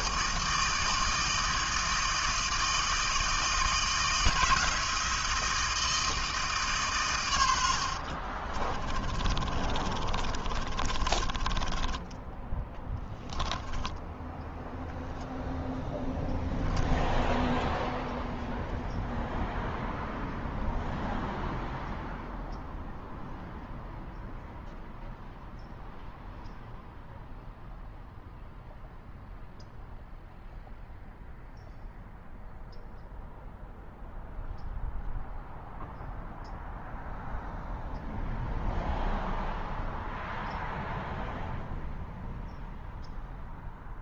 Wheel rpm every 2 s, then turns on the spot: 160, 160, 160, 150, 40, 30, 10, 0, 0, 0, 0, 0, 0, 0, 0, 0, 0, 0, 0, 0, 0, 0.
8-14